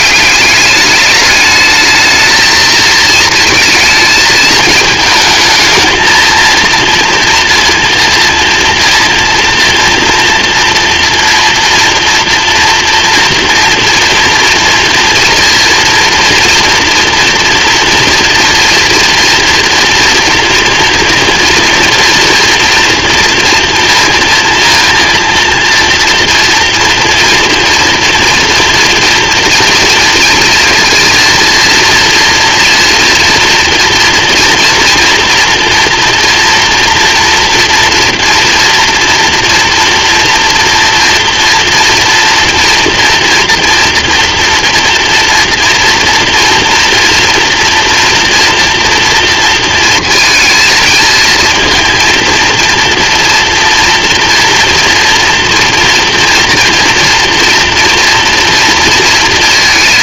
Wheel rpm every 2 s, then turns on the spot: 200, 220, 220, 230, 230, 230, 230, 240, 230, 230, 230, 230, 230, 230, 230, 230, 230, 230, 240, 230, 230, 240, 230, 230, 230, 230, 230, 240, 230, 230.
none